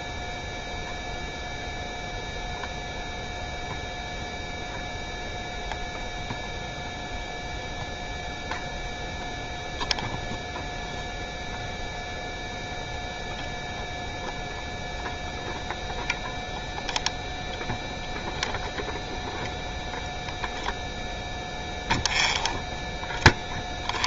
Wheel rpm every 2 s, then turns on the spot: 0, 0, 0, 0, 0, 0, 0, 0, 0, 0, 0, 0.
none